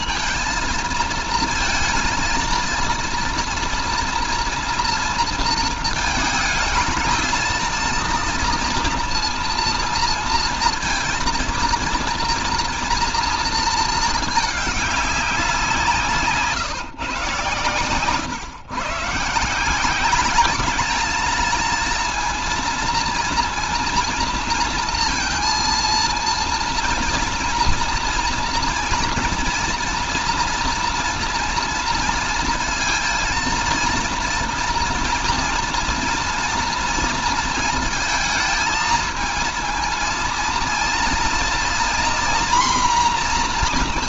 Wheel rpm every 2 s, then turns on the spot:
230, 230, 230, 220, 230, 230, 230, 210, 150, 130, 210, 230, 230, 230, 230, 230, 230, 230, 230, 220, 230, 240.
none